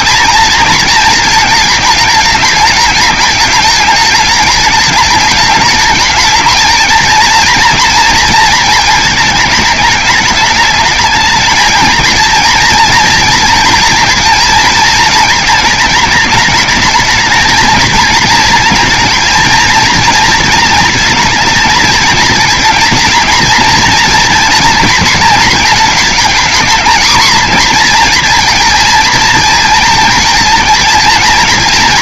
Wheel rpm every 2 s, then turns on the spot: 230, 200, 210, 220, 220, 210, 230, 230, 220, 230, 230, 230, 230, 230, 230, 230.
none